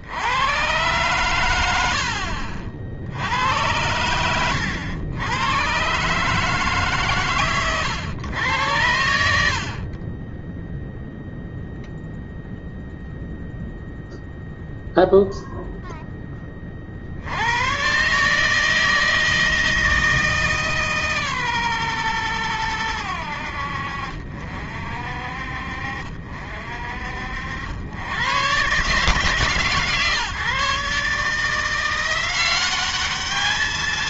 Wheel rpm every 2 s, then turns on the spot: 90, 80, 100, 130, 110, 30, 0, 0, 20, 140, 150, 110, 60, 60, 120, 140, 180.
none